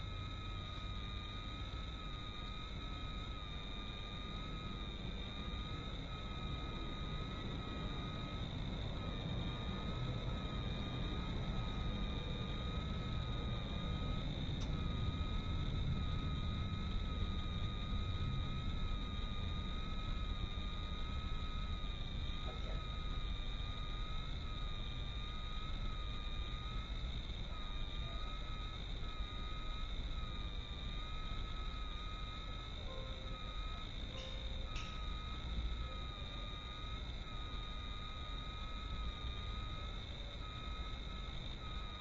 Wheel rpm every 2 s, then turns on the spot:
0, 0, 0, 0, 0, 0, 0, 0, 0, 0, 0, 0, 0, 0, 0, 0, 0, 0, 0, 0, 0.
none